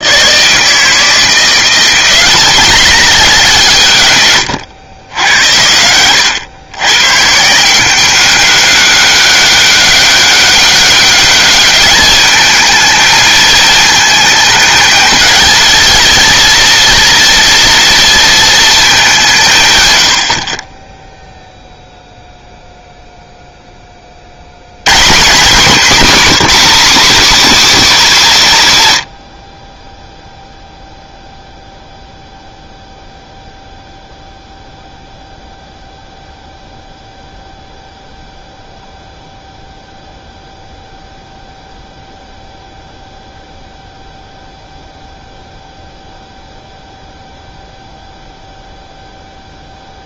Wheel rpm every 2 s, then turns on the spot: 150, 200, 110, 110, 200, 200, 220, 220, 230, 220, 30, 0, 100, 240, 160, 0, 0, 0, 0, 0, 0, 0, 0, 0, 0.
none